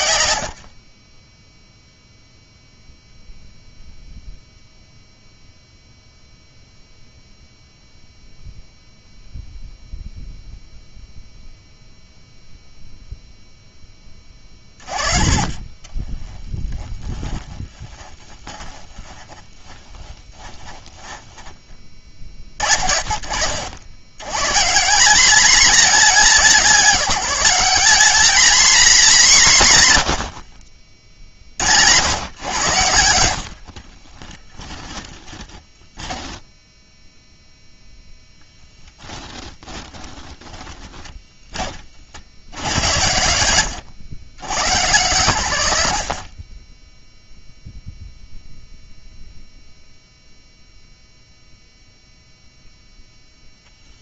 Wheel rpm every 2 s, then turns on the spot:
10, 0, 0, 0, 0, 0, 0, 20, 20, 20, 10, 50, 180, 190, 210, 40, 90, 10, 0, 20, 10, 90, 110, 10, 0, 0, 0.
14-22 34-36 38-40